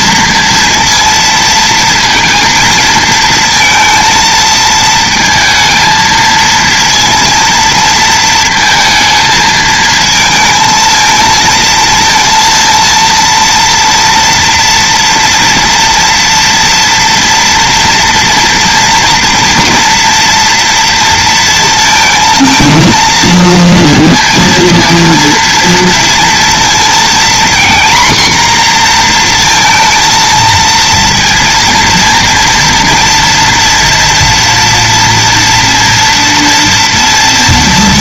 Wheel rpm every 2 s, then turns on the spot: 230, 230, 230, 230, 230, 220, 230, 240, 230, 240, 230, 220, 230, 230, 240, 230, 230, 230, 230.
none